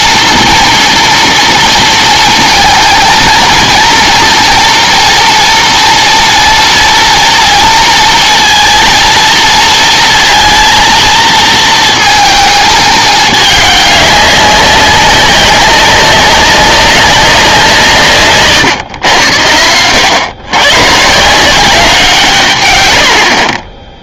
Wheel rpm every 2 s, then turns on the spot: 240, 230, 230, 230, 230, 230, 220, 200, 200, 130, 120, 120.
18-20